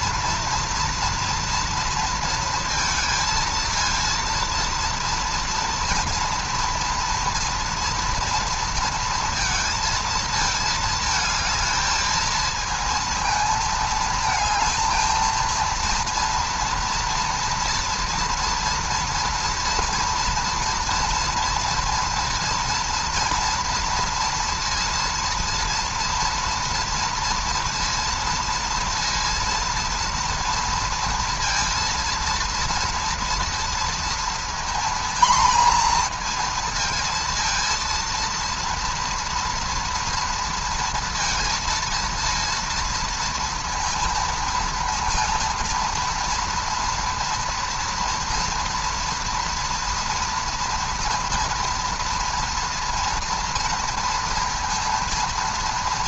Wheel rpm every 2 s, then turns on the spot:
230, 230, 240, 240, 230, 220, 230, 220, 230, 230, 230, 230, 230, 230, 230, 240, 230, 240, 230, 230, 230, 230, 230, 230, 230, 230, 230, 230.
none